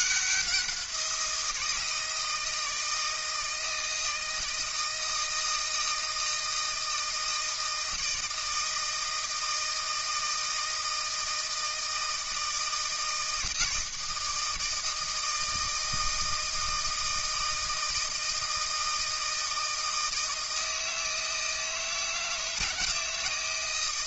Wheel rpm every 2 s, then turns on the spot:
180, 160, 160, 160, 160, 160, 160, 160, 160, 160, 160, 160.
none